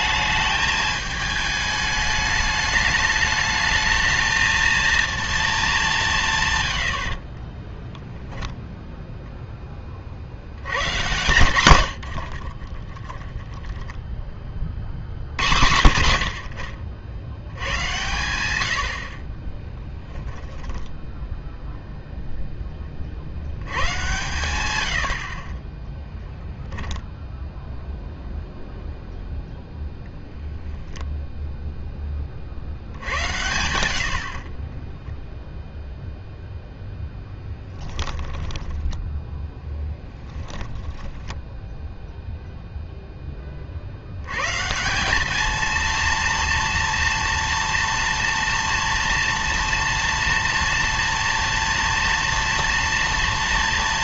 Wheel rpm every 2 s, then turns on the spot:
210, 210, 220, 110, 0, 110, 30, 40, 60, 90, 10, 10, 100, 10, 0, 0, 60, 20, 0, 10, 10, 0, 160, 230, 230, 230, 230.
12-14 20-22 26-28 38-40